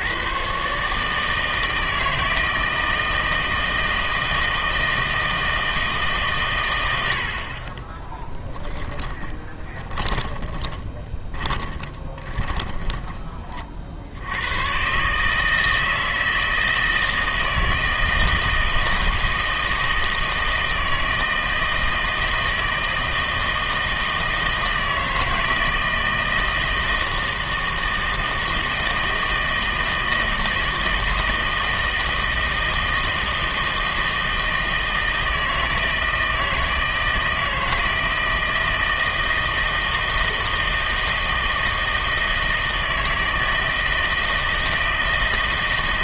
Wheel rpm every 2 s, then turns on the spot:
140, 160, 160, 100, 20, 20, 20, 120, 160, 160, 160, 160, 160, 160, 160, 160, 160, 160, 160, 160, 160, 160, 160.
8-14